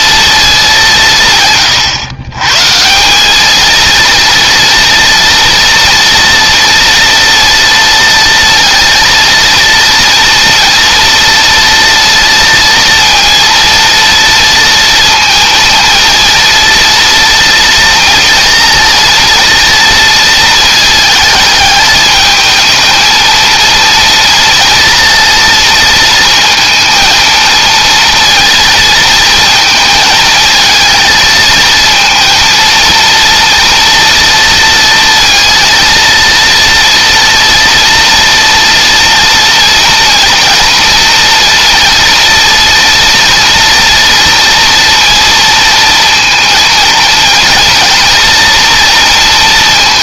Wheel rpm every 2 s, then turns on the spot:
170, 180, 230, 230, 230, 230, 230, 230, 230, 230, 220, 230, 230, 230, 230, 220, 230, 230, 240, 230, 230, 230, 230, 220, 230.
none